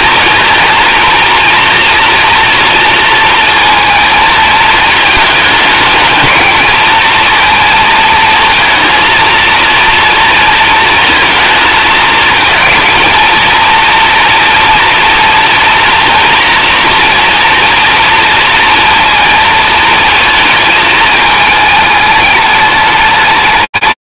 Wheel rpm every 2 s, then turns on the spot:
230, 230, 220, 230, 230, 230, 220, 230, 230, 230, 220, 210.
none